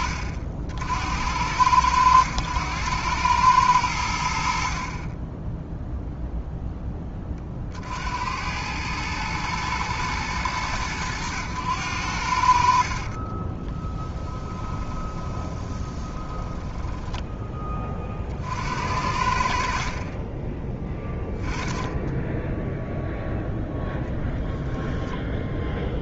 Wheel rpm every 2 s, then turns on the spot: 70, 100, 50, 10, 100, 100, 60, 20, 10, 60, 10, 0, 0.
14-18